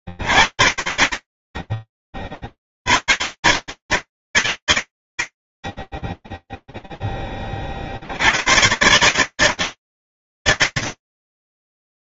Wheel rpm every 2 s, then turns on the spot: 20, 120, 40, 10, 140, 140.
none